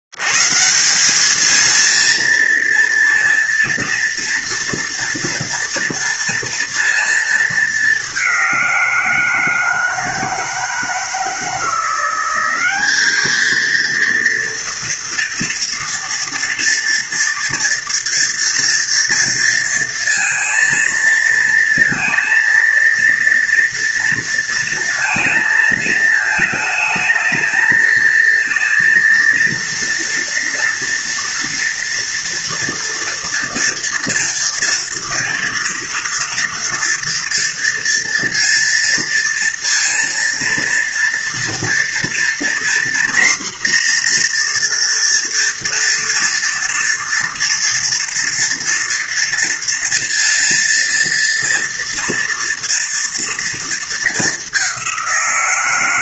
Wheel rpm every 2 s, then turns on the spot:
70, 230, 230, 230, 200, 160, 180, 230, 230, 230, 230, 230, 230, 220, 230, 230, 230, 240, 230, 230, 230, 240, 240, 230, 240, 230, 230, 210.
none